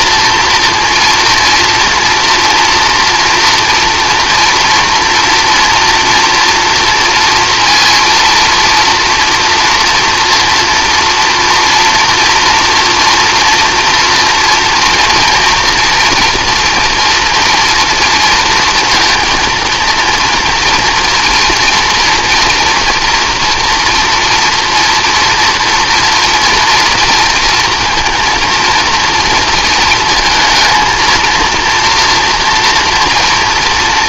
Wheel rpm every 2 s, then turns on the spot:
230, 230, 230, 230, 230, 230, 240, 240, 240, 230, 230, 230, 230, 230, 230, 220, 230.
none